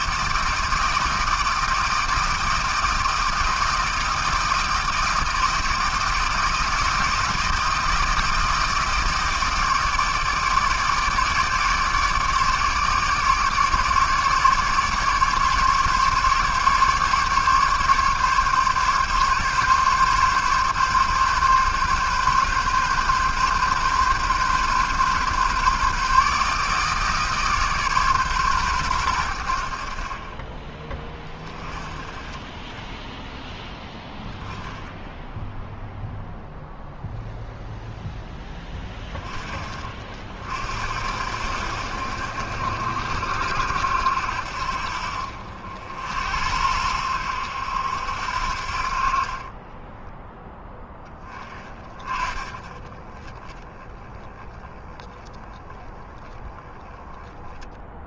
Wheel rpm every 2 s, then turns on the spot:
160, 160, 160, 160, 160, 160, 150, 150, 150, 140, 140, 130, 140, 150, 110, 20, 10, 10, 0, 20, 70, 70, 60, 80, 50, 10, 30, 10, 10.
32-34